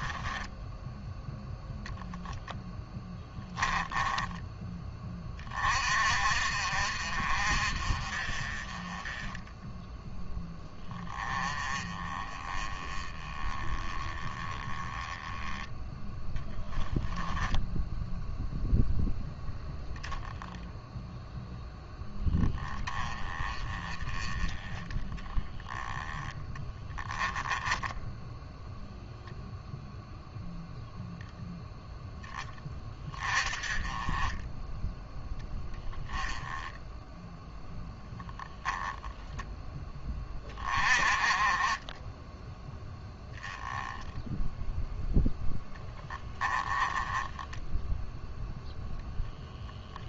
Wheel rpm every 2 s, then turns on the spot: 10, 10, 20, 50, 30, 10, 20, 10, 10, 0, 0, 20, 10, 10, 0, 0, 20, 10, 10, 0, 30, 10, 10, 30, 0.
2-4 16-18 26-28 46-48